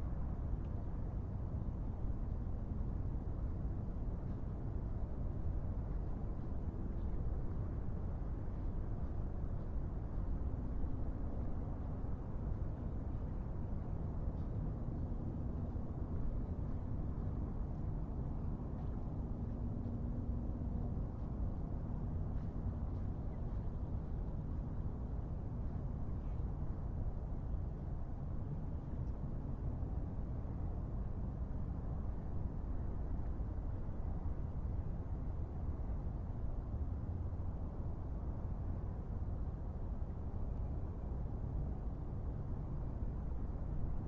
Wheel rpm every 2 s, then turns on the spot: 0, 0, 0, 0, 0, 0, 0, 0, 0, 0, 0, 0, 0, 0, 0, 0, 0, 0, 0, 0, 0, 0.
none